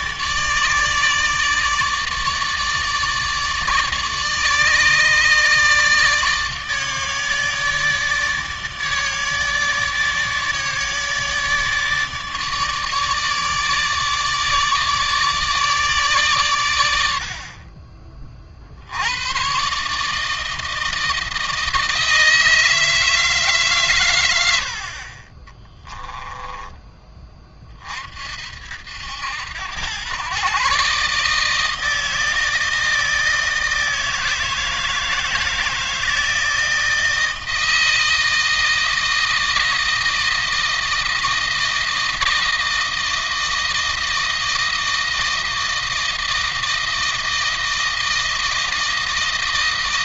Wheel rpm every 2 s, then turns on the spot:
150, 150, 150, 150, 150, 150, 150, 150, 100, 60, 160, 160, 60, 20, 70, 140, 160, 160, 160, 160, 160, 160, 160, 160, 160.
24-26